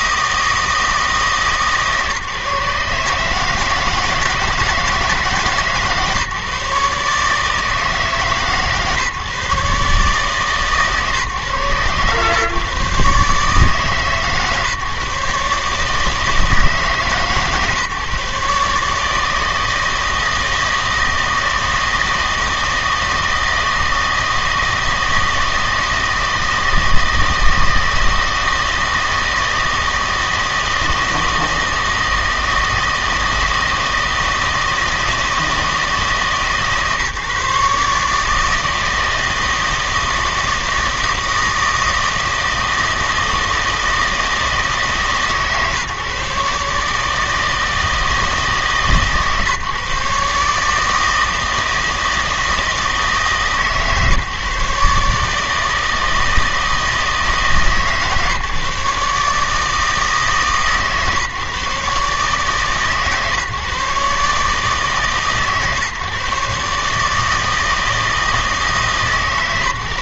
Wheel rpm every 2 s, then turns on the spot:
160, 150, 160, 150, 150, 150, 130, 140, 150, 140, 160, 160, 160, 160, 160, 160, 160, 160, 140, 160, 160, 160, 150, 150, 150, 150, 160, 140, 160, 150, 150, 140, 140, 140, 150.
none